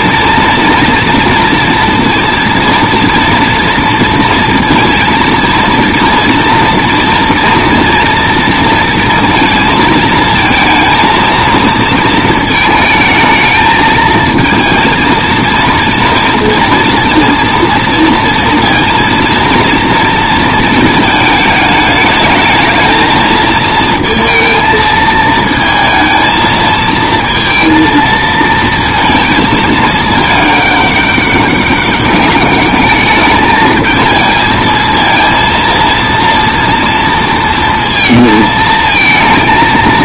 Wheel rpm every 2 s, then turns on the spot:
230, 230, 230, 230, 230, 230, 220, 230, 230, 230, 230, 220, 230, 220, 230, 210, 200, 220, 230, 220.
none